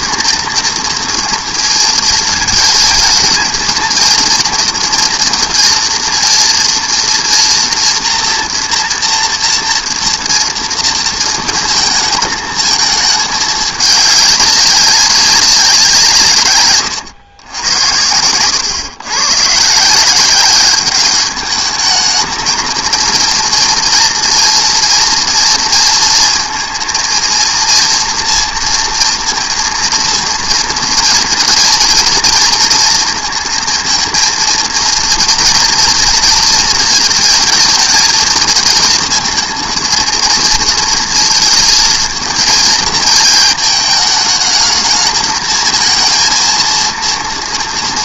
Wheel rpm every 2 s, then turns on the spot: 230, 220, 230, 230, 240, 230, 220, 200, 120, 110, 190, 220, 230, 230, 230, 230, 230, 230, 230, 220, 220, 220, 220, 230.
18-20